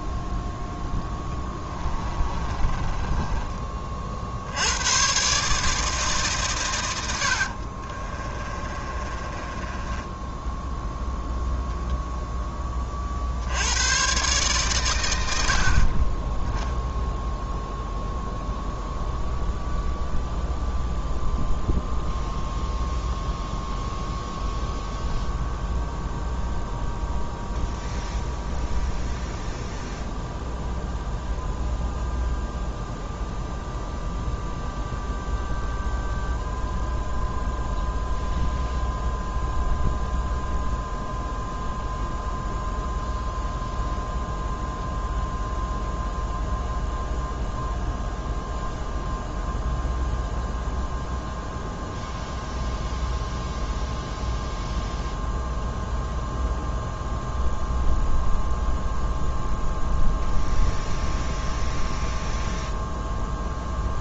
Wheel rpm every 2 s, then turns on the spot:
10, 20, 90, 120, 30, 0, 20, 120, 0, 0, 0, 0, 0, 0, 0, 0, 0, 0, 0, 0, 0, 0, 0, 0, 0, 0, 0, 0, 0, 0, 0, 0.
2-4 8-10